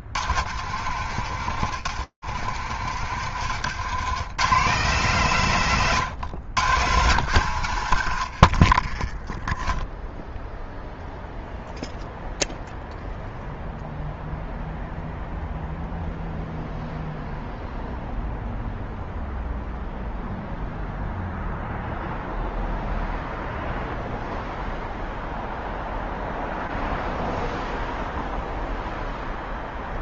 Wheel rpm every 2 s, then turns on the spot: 90, 70, 80, 130, 90, 0, 0, 0, 0, 0, 0, 0, 0, 0, 0.
2-4